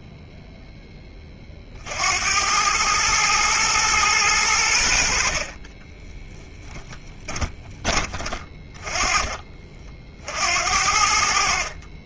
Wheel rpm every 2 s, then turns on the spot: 10, 100, 90, 10, 30, 70.
6-8